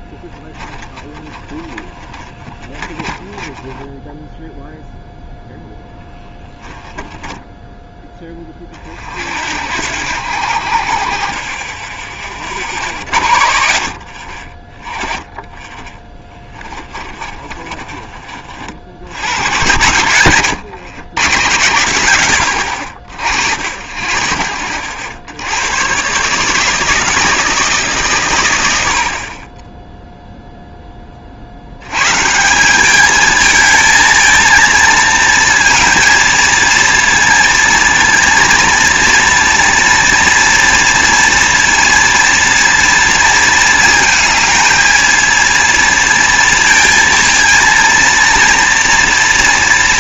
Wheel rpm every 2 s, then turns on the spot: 10, 20, 0, 10, 20, 60, 40, 30, 20, 50, 80, 70, 60, 150, 100, 0, 180, 230, 230, 230, 240, 230, 220, 230, 230.
0-4 6-8 16-18